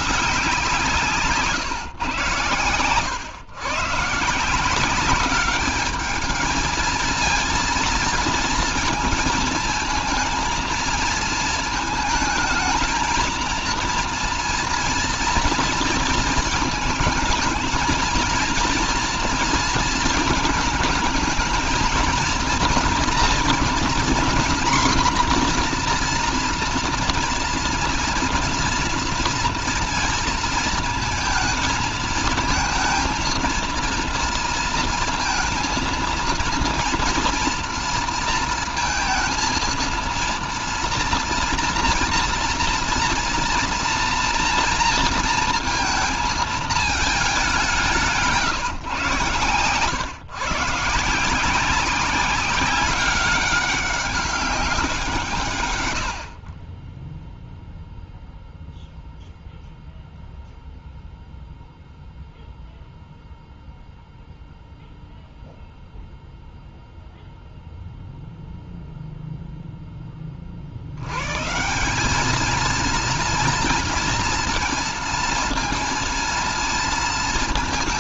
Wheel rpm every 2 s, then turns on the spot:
170, 110, 190, 220, 230, 230, 230, 230, 220, 230, 220, 230, 250, 240, 230, 220, 230, 230, 230, 230, 230, 230, 230, 220, 130, 150, 190, 180, 20, 0, 0, 0, 0, 0, 0, 90, 230, 230, 230.
none